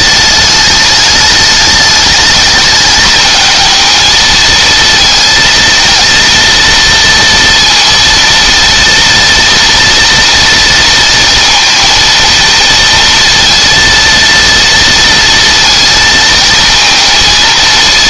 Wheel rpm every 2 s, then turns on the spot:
210, 210, 230, 230, 230, 230, 230, 230, 230.
none